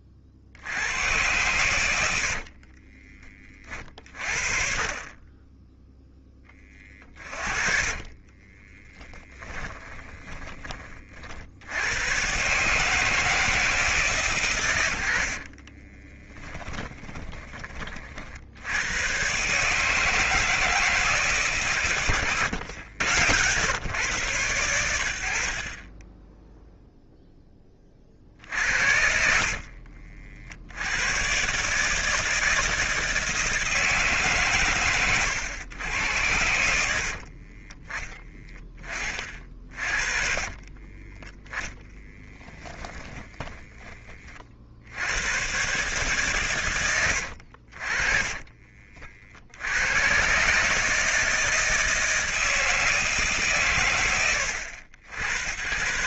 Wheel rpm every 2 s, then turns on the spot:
50, 40, 40, 20, 30, 40, 140, 120, 20, 80, 160, 110, 90, 0, 50, 70, 160, 110, 80, 20, 20, 10, 60, 120, 40, 140, 160, 80.
2-4 6-10 16-18 22-24 28-30 40-44